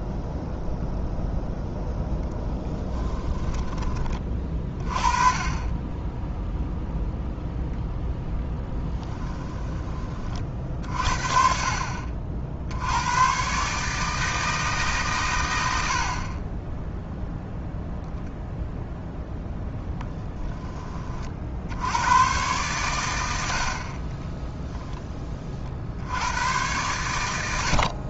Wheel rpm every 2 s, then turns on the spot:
0, 10, 30, 0, 10, 50, 90, 150, 10, 0, 20, 110, 0, 100.
2-4 8-10